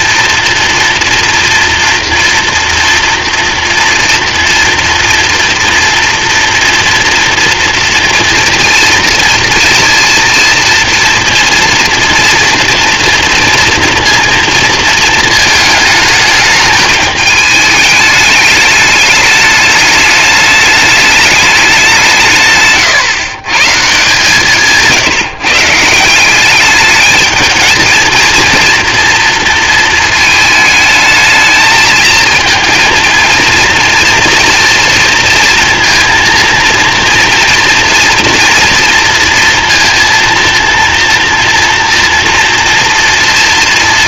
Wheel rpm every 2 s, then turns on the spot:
230, 230, 230, 230, 230, 230, 230, 230, 210, 210, 210, 130, 160, 210, 230, 220, 230, 230, 230, 230, 230, 230.
22-24